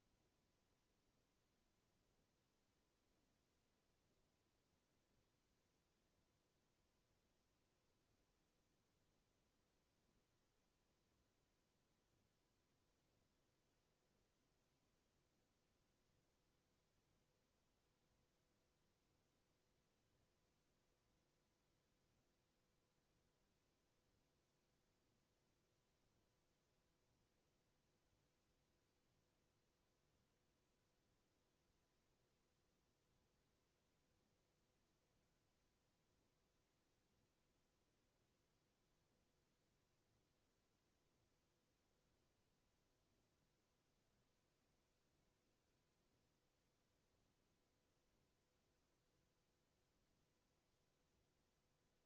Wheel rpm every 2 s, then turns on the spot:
0, 0, 0, 0, 0, 0, 0, 0, 0, 0, 0, 0, 0, 0, 0, 0, 0, 0, 0, 0, 0, 0, 0, 0, 0, 0.
none